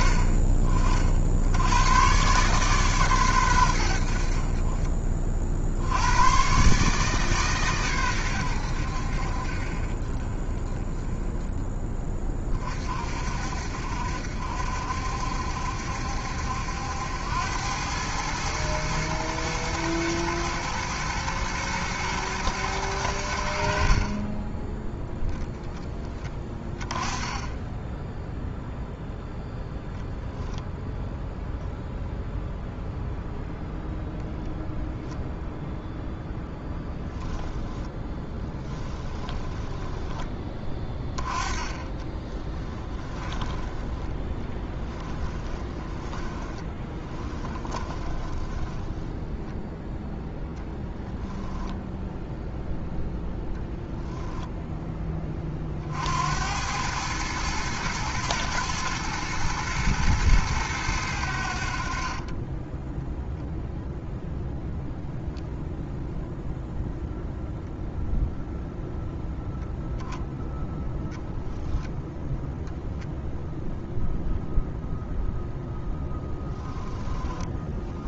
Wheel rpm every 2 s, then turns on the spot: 40, 60, 120, 60, 140, 40, 10, 60, 70, 100, 120, 110, 50, 20, 10, 0, 0, 0, 0, 10, 10, 30, 10, 20, 20, 0, 0, 0, 60, 110, 110, 50, 0, 0, 0, 0, 0, 0, 10.
28-30 38-50 76-78